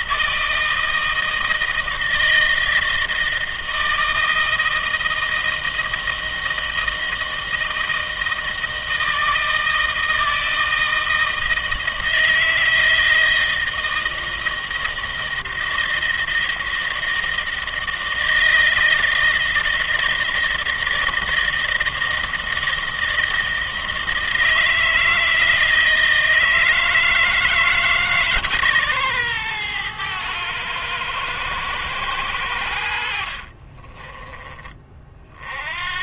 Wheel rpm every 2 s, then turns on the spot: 160, 160, 160, 160, 160, 160, 160, 160, 160, 160, 160, 160, 160, 160, 140, 110, 80, 30.
none